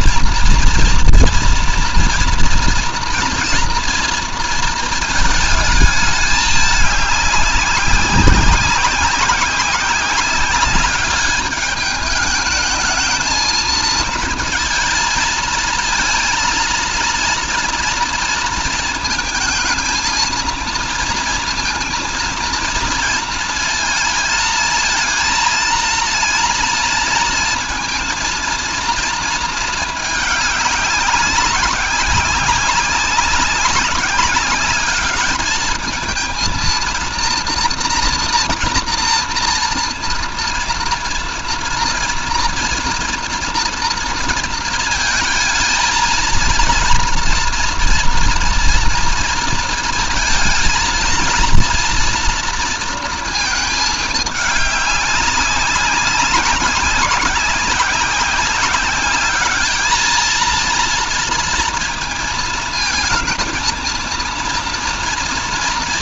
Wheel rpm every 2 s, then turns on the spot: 230, 230, 220, 200, 190, 200, 220, 230, 230, 220, 230, 220, 230, 230, 230, 200, 200, 210, 230, 230, 230, 240, 230, 230, 230, 240, 230, 200, 190, 200, 230, 230, 230.
none